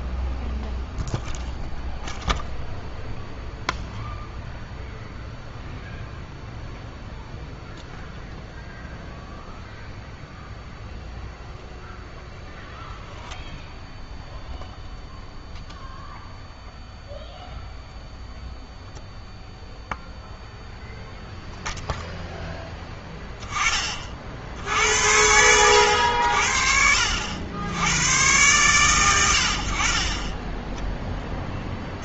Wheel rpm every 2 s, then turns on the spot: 0, 0, 0, 0, 0, 0, 0, 0, 0, 0, 0, 10, 70, 60, 120, 10.
none